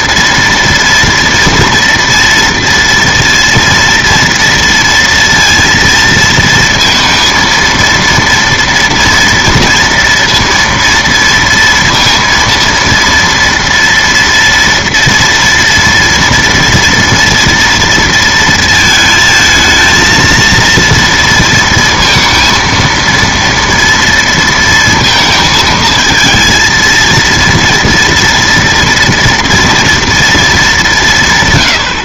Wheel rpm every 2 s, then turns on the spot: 230, 230, 230, 230, 230, 230, 230, 240, 230, 230, 230, 230, 230, 230, 230, 210.
none